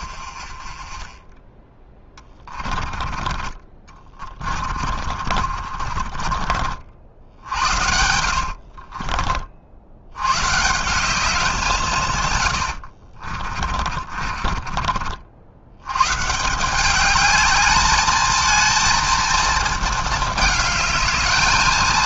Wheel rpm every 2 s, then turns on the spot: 30, 20, 40, 60, 50, 160, 80, 40, 190, 220, 210.
0-6 8-10 12-16